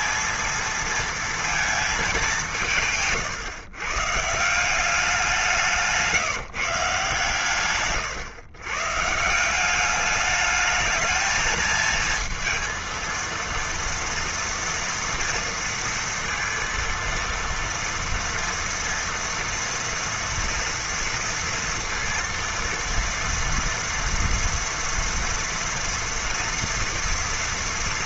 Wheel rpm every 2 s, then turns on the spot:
220, 170, 180, 150, 130, 220, 230, 230, 230, 230, 230, 230, 240, 230.
none